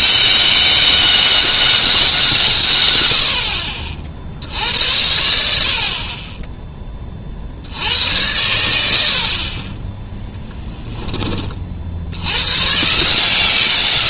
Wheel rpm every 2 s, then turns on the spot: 190, 140, 70, 20, 90, 10, 120.
10-12